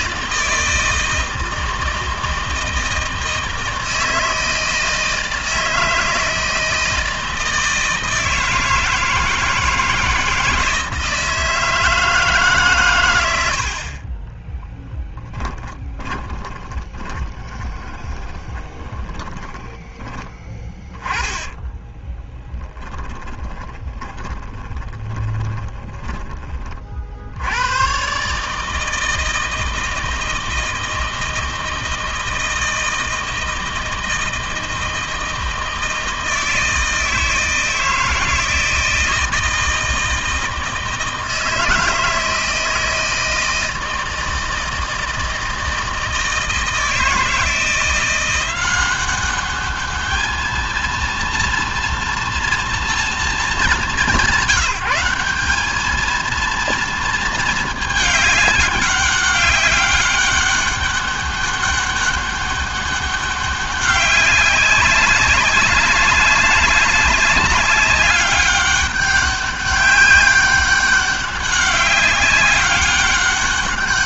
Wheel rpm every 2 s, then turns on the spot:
160, 160, 160, 160, 160, 160, 130, 10, 20, 10, 10, 20, 20, 40, 150, 160, 160, 160, 160, 160, 160, 160, 160, 160, 190, 220, 230, 170, 230, 200, 200, 200, 200, 200, 200, 200, 200.
14-26